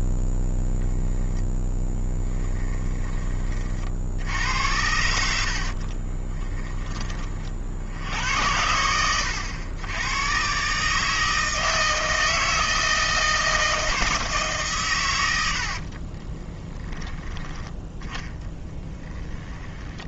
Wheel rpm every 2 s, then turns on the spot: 0, 10, 80, 10, 70, 140, 160, 130, 10, 10.
none